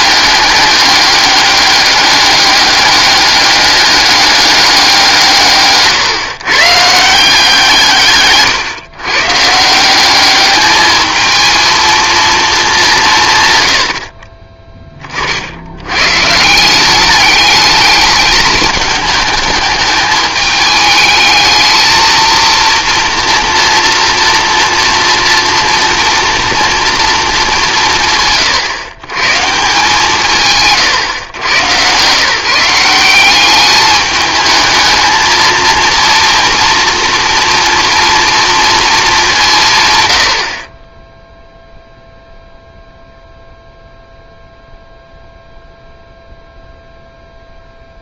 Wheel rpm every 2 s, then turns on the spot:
210, 200, 190, 160, 140, 210, 200, 30, 190, 210, 220, 230, 230, 230, 120, 130, 180, 220, 230, 220, 30, 0, 0, 0.
none